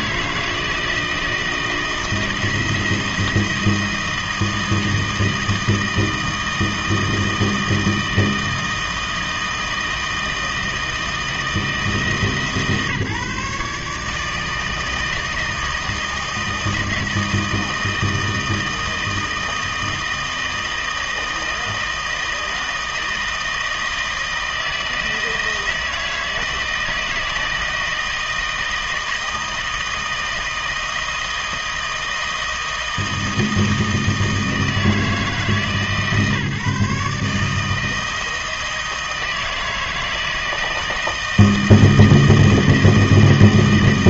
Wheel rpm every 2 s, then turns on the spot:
160, 160, 160, 160, 160, 160, 150, 160, 160, 160, 160, 160, 160, 160, 160, 160, 160, 160, 150, 160, 160, 160.
none